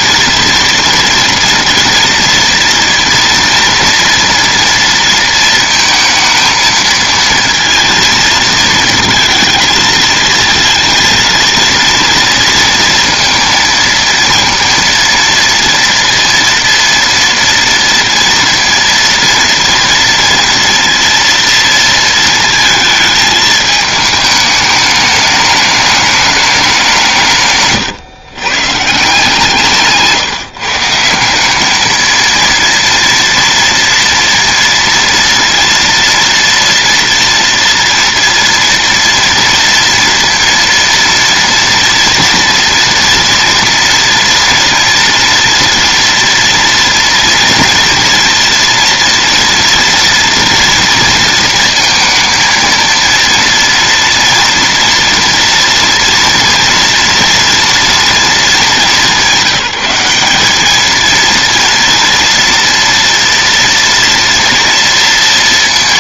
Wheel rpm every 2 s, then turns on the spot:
230, 230, 230, 230, 230, 230, 230, 230, 230, 230, 230, 230, 210, 210, 140, 160, 220, 230, 230, 230, 230, 230, 230, 230, 230, 230, 230, 230, 230, 230, 200, 230, 230.
none